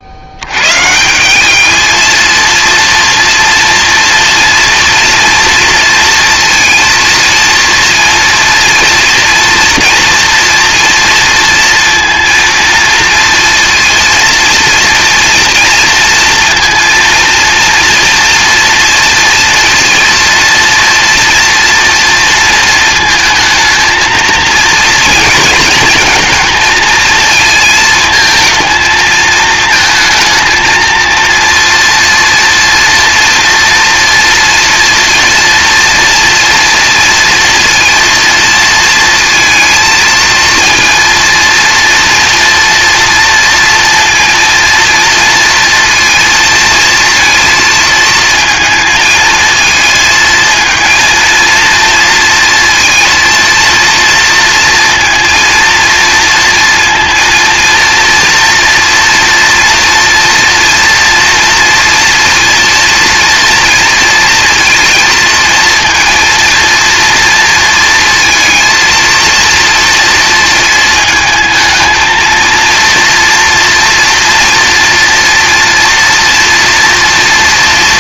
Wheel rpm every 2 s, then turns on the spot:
110, 230, 240, 230, 230, 230, 230, 230, 230, 230, 230, 230, 230, 230, 220, 230, 230, 230, 230, 230, 230, 230, 230, 230, 220, 220, 230, 230, 230, 230, 240, 230, 230, 230, 230, 230, 230, 230, 230.
none